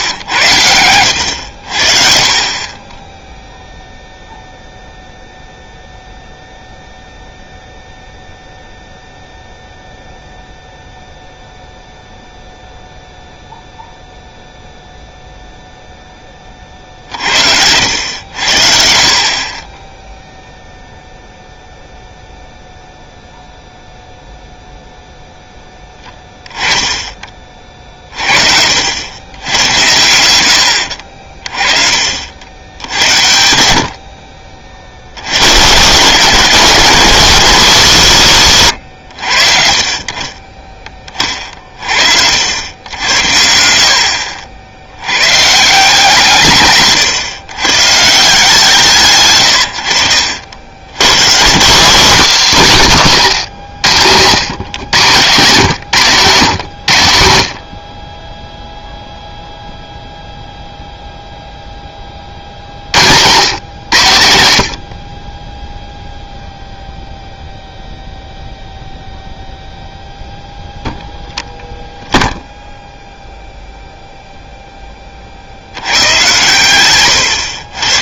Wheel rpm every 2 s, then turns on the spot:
110, 30, 0, 0, 0, 0, 0, 0, 30, 70, 0, 0, 0, 10, 50, 90, 80, 50, 180, 140, 40, 80, 60, 150, 170, 80, 200, 110, 120, 0, 0, 40, 100, 0, 0, 0, 0, 0, 110.
none